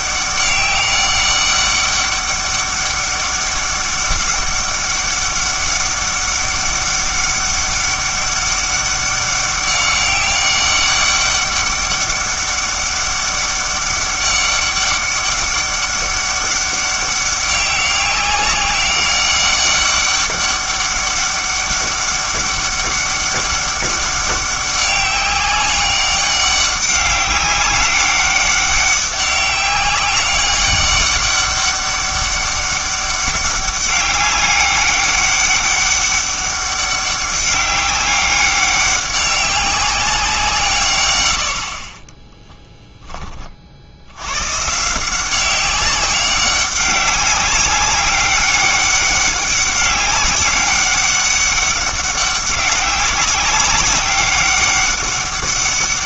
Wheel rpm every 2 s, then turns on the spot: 200, 200, 200, 200, 200, 200, 200, 200, 200, 190, 200, 200, 200, 200, 200, 200, 200, 200, 200, 200, 150, 0, 140, 200, 200, 200, 190, 200.
none